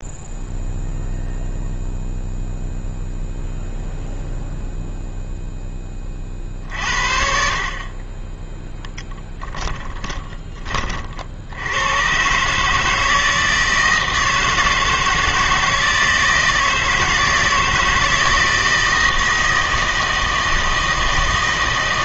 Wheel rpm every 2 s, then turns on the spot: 0, 0, 0, 50, 10, 30, 150, 160, 160, 160, 160.
none